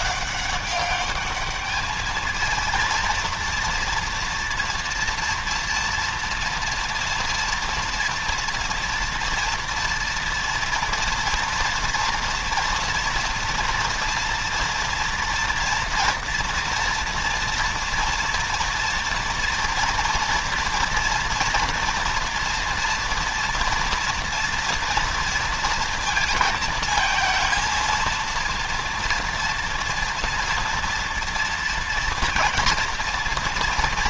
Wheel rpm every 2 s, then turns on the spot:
190, 220, 230, 230, 230, 230, 230, 230, 240, 240, 230, 230, 240, 230, 230, 230, 230.
none